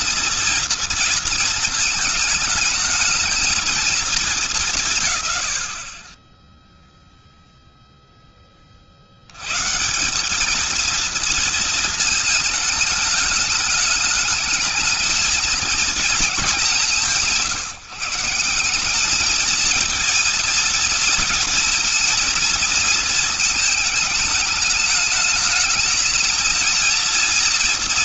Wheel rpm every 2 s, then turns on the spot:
230, 220, 170, 10, 80, 230, 220, 220, 180, 210, 230, 220, 220, 230.
none